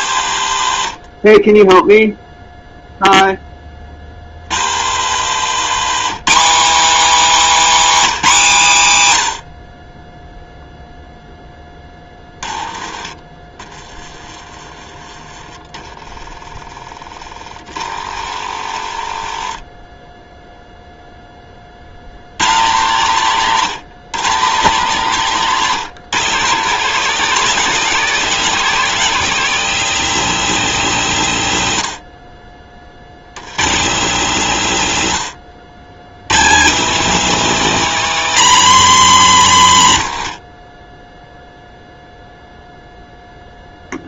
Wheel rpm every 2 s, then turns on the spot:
80, 0, 80, 260, 200, 0, 30, 20, 20, 60, 0, 120, 150, 160, 200, 190, 40, 140, 180, 250, 60, 0.
0-2 4-6 40-42